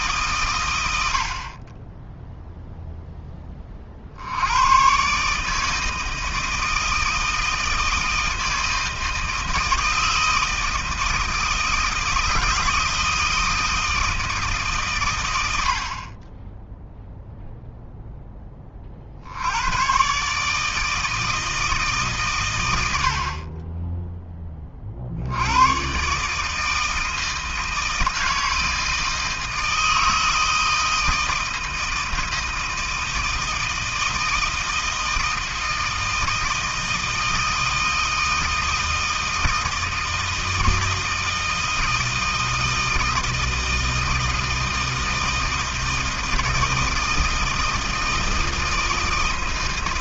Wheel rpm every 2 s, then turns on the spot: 110, 0, 110, 160, 160, 160, 160, 140, 0, 20, 150, 100, 30, 160, 160, 160, 160, 160, 160, 160, 160, 160, 160, 160, 160.
none